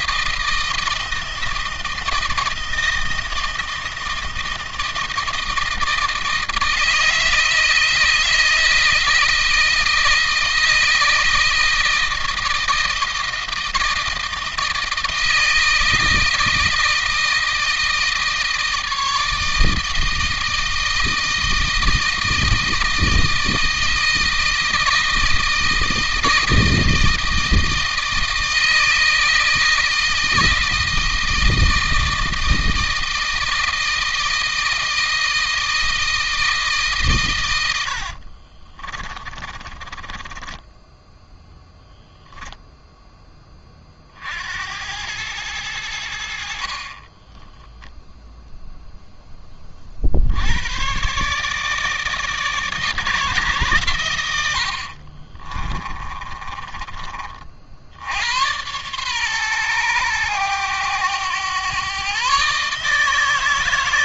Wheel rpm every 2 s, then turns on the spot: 160, 160, 160, 160, 160, 160, 160, 160, 160, 160, 160, 160, 160, 160, 160, 160, 160, 160, 140, 30, 10, 10, 90, 40, 0, 120, 150, 60, 30, 110, 100, 150.
38-42 46-48 54-56